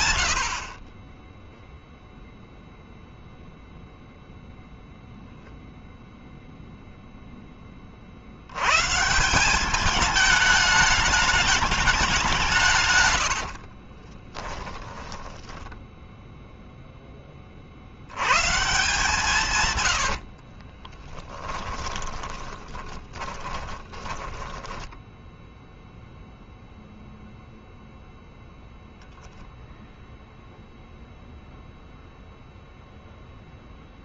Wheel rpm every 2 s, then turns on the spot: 0, 0, 0, 70, 220, 170, 10, 0, 70, 90, 20, 10, 0, 0, 0, 0, 0.
12-14 18-24